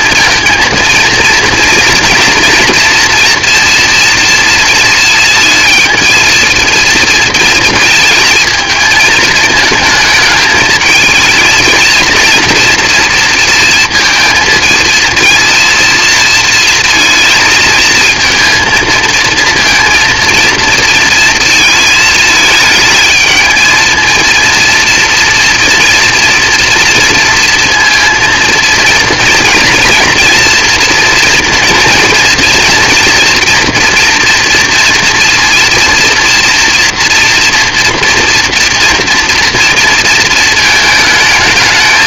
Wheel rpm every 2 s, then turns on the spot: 230, 230, 220, 230, 220, 220, 230, 230, 220, 220, 230, 220, 230, 230, 230, 230, 230, 240, 230, 230, 220.
none